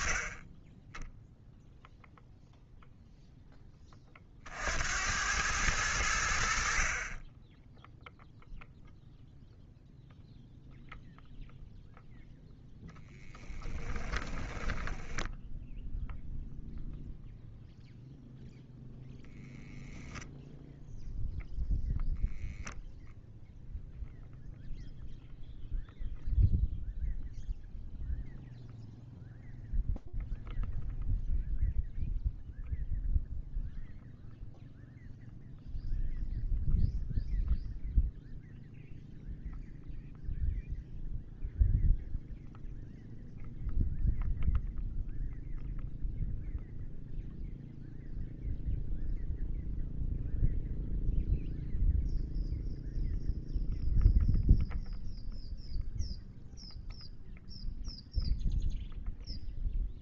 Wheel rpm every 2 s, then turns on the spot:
0, 0, 90, 10, 0, 0, 10, 0, 0, 0, 10, 0, 0, 0, 0, 0, 0, 0, 0, 0, 0, 0, 0, 0, 0, 0, 0, 0, 0, 0.
12-14